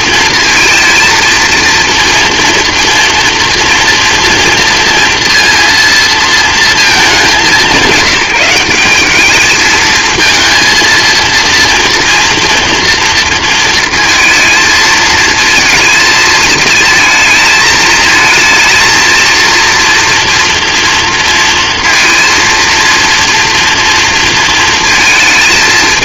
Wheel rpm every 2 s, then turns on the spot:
230, 230, 230, 220, 190, 230, 230, 230, 220, 230, 230, 230, 230.
none